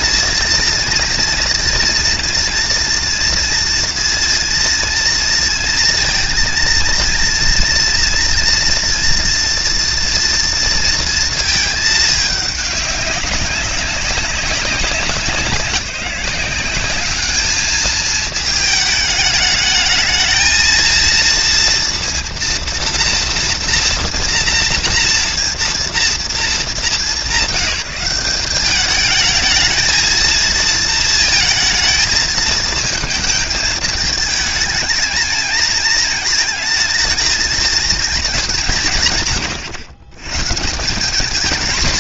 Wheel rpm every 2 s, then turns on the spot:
230, 240, 230, 230, 230, 230, 200, 190, 200, 210, 230, 230, 240, 200, 210, 230, 220, 220, 220, 150, 180.
none